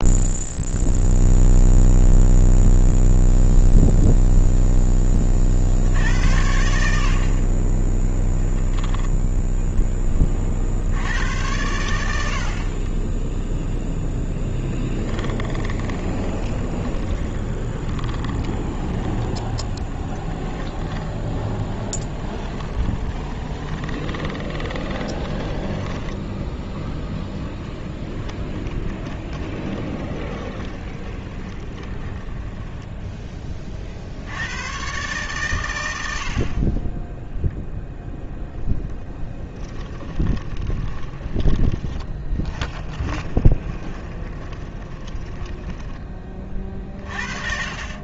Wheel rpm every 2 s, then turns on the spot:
0, 0, 10, 70, 10, 70, 30, 10, 20, 20, 20, 20, 20, 10, 20, 20, 10, 120, 20, 0, 20, 20, 20, 40.
8-10 12-14 16-26 28-32 40-48